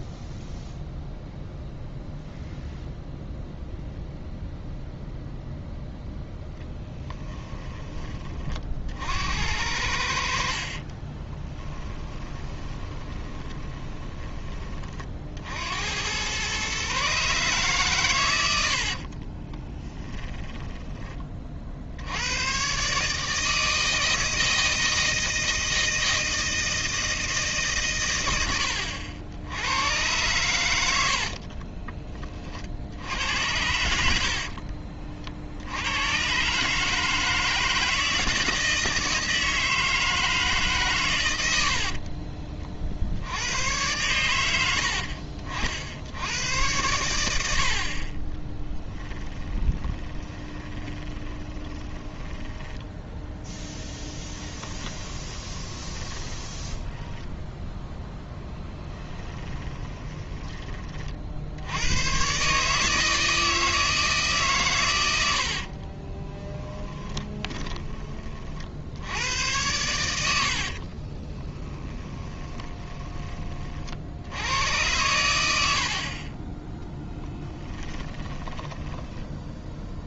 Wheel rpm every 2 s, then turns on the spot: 0, 0, 0, 10, 50, 30, 20, 40, 140, 60, 10, 140, 160, 160, 70, 90, 70, 50, 150, 160, 140, 50, 70, 90, 10, 20, 10, 20, 10, 10, 30, 150, 120, 10, 70, 40, 20, 90, 10, 10.
6-8 10-14 18-20 48-60 66-68 70-74 78-80